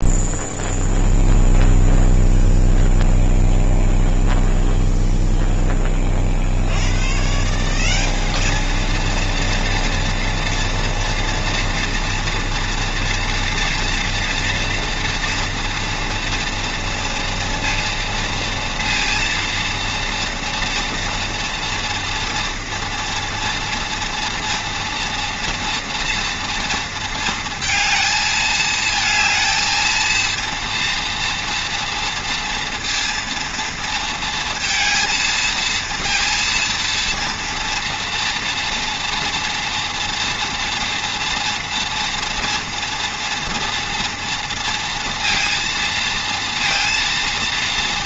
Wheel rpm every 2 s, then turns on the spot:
0, 0, 0, 100, 220, 230, 230, 230, 230, 230, 230, 230, 230, 230, 220, 230, 230, 230, 230, 230, 230, 240, 230, 230.
none